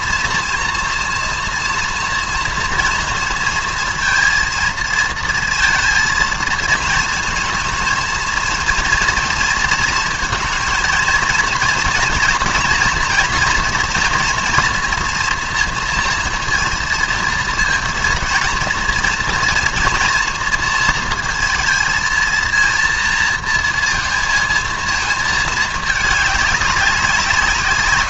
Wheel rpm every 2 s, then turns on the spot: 230, 230, 230, 220, 230, 220, 230, 240, 230, 230, 230, 230, 220, 200.
none